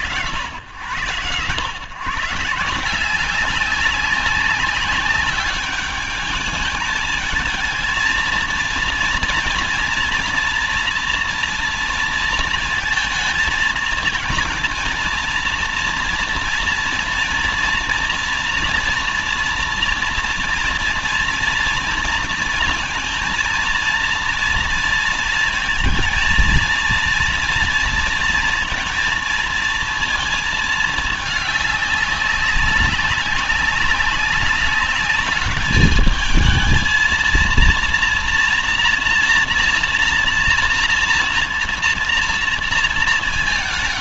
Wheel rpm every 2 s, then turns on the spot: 90, 170, 200, 210, 230, 230, 230, 230, 240, 240, 230, 230, 230, 230, 220, 220, 200, 200, 230, 230, 230, 230.
none